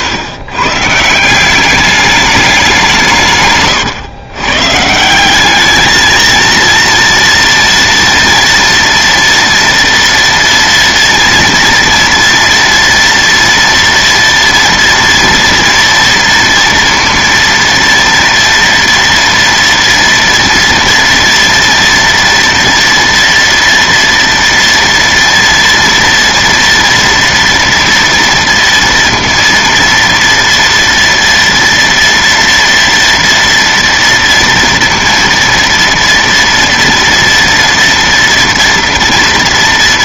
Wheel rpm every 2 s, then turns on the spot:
130, 190, 140, 230, 230, 230, 230, 230, 240, 230, 230, 240, 240, 230, 230, 230, 230, 230, 230, 230.
none